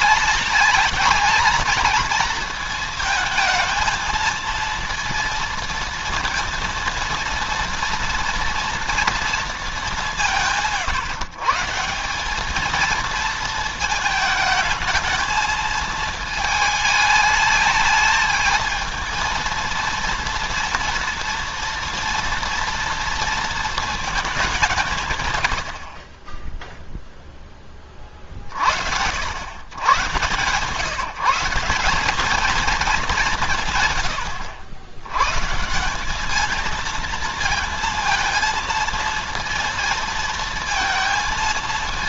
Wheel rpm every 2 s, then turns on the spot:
210, 230, 230, 240, 230, 170, 210, 220, 220, 220, 230, 230, 190, 10, 60, 140, 220, 110, 220, 230, 230.
none